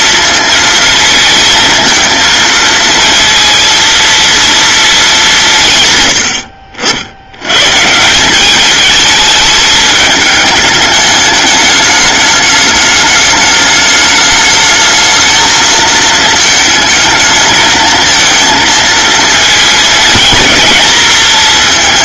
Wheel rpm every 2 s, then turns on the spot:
230, 230, 220, 70, 210, 210, 210, 220, 220, 220, 230.
none